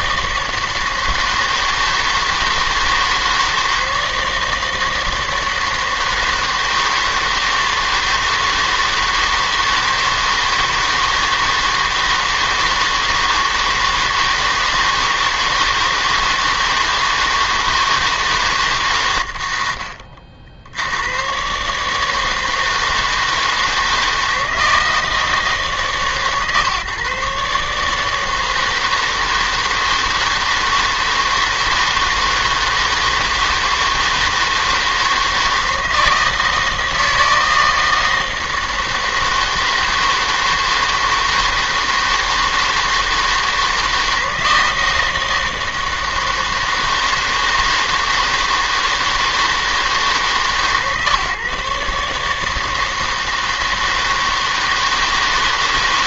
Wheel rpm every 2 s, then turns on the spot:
160, 160, 160, 160, 160, 160, 160, 160, 160, 130, 80, 160, 160, 140, 160, 160, 160, 160, 160, 160, 160, 160, 160, 160, 160, 140, 160, 160.
none